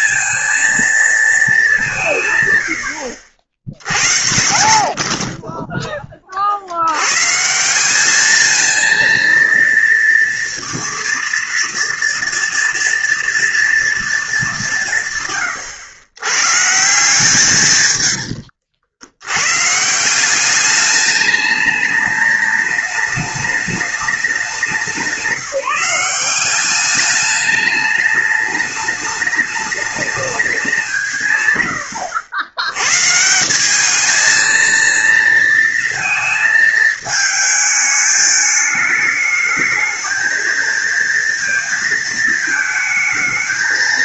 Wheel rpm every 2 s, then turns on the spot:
230, 80, 50, 100, 220, 230, 230, 150, 150, 80, 210, 210, 170, 200, 210, 160, 130, 230, 220, 220, 230, 220.
none